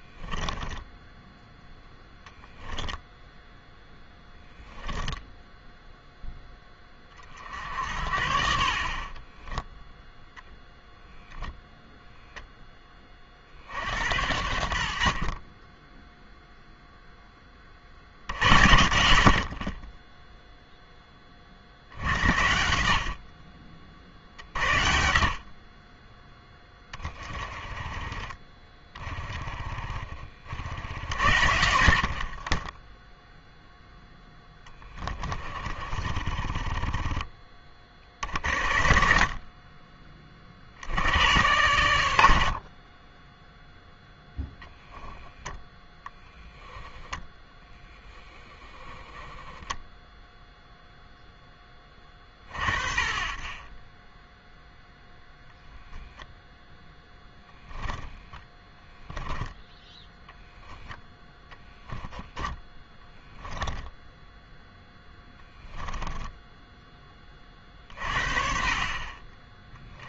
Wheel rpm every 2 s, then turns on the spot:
10, 0, 0, 20, 50, 0, 10, 70, 0, 80, 0, 70, 60, 10, 10, 60, 20, 10, 20, 30, 60, 40, 0, 0, 10, 0, 50, 10, 10, 0, 0, 10, 0, 10, 40.
0-2 32-38